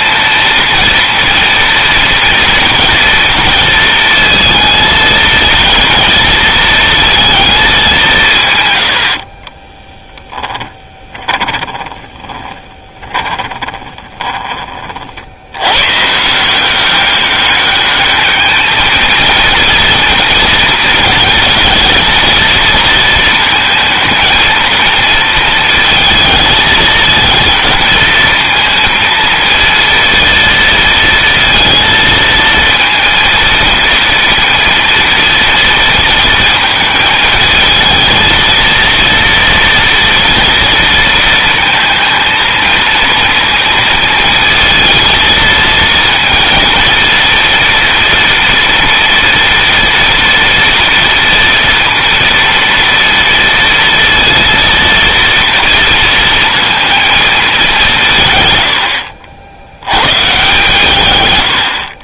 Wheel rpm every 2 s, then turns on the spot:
230, 230, 220, 230, 100, 10, 20, 40, 180, 220, 220, 230, 230, 220, 230, 230, 230, 240, 220, 230, 230, 230, 220, 230, 230, 230, 230, 230, 230, 100, 130.
10-14